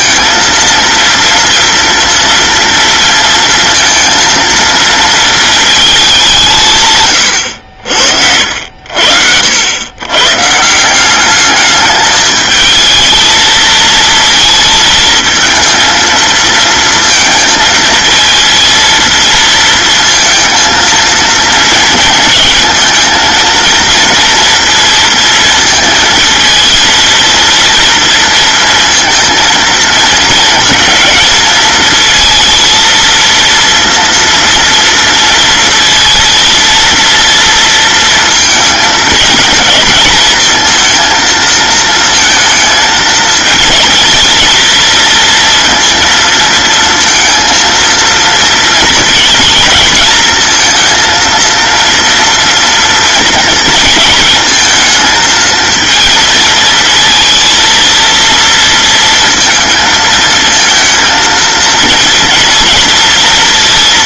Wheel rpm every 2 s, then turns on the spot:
230, 230, 230, 170, 70, 150, 220, 220, 230, 230, 230, 230, 230, 230, 230, 230, 230, 230, 230, 220, 220, 230, 230, 230, 230, 230, 230, 230, 230, 230, 220, 230.
none